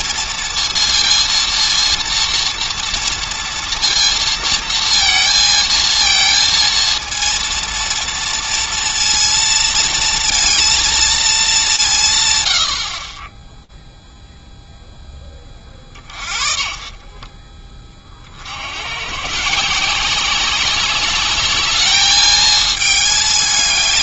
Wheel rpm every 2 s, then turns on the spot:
230, 230, 230, 230, 230, 230, 80, 0, 40, 90, 190, 220.
16-18